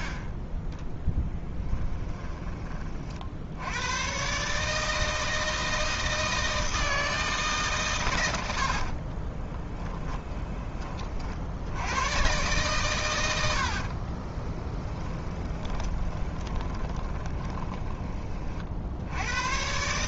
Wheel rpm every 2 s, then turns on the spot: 20, 40, 160, 160, 50, 30, 120, 10, 20, 70.
8-10 14-18